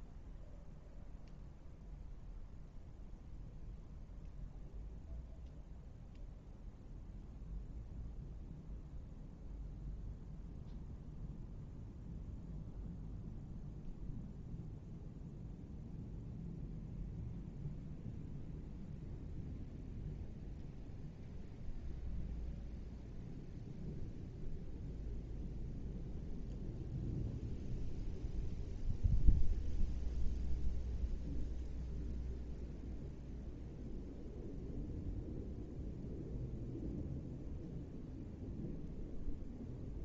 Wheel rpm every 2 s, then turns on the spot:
0, 0, 0, 0, 0, 0, 0, 0, 0, 0, 0, 0, 0, 0, 0, 0, 0, 0, 0, 0.
none